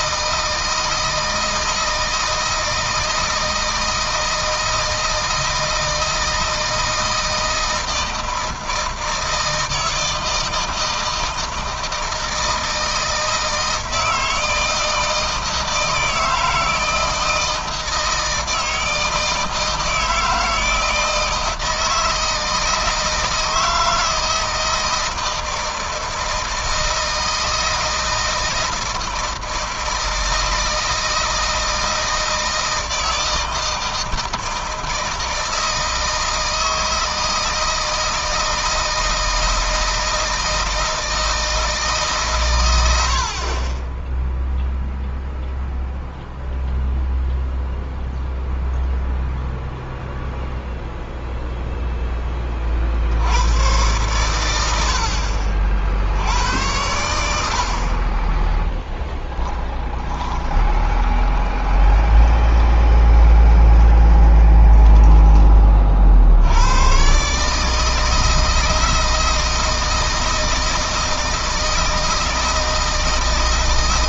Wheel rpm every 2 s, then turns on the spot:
160, 160, 160, 160, 160, 160, 160, 160, 160, 160, 160, 160, 160, 160, 160, 160, 160, 160, 160, 160, 160, 80, 0, 0, 0, 0, 50, 80, 80, 0, 20, 20, 20, 110, 160, 160, 160.
60-66